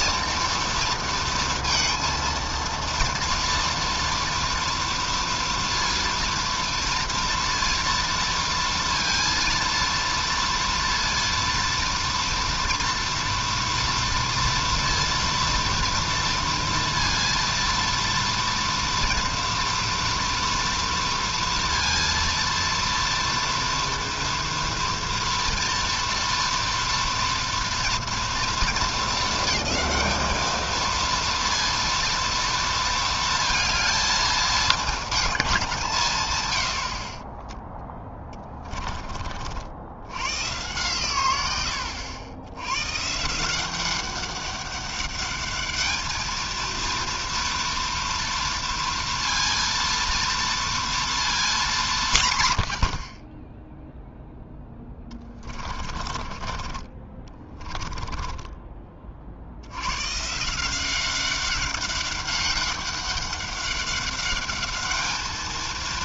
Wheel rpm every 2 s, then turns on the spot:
230, 230, 230, 230, 230, 230, 230, 230, 230, 230, 230, 230, 230, 230, 220, 230, 220, 220, 40, 50, 90, 170, 200, 230, 230, 220, 30, 20, 20, 60, 190, 200, 220.
36-38 54-58